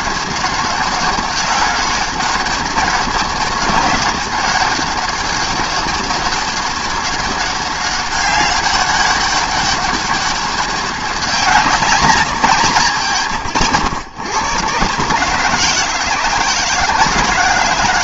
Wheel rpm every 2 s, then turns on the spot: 190, 200, 200, 200, 200, 200, 160, 130, 160.
none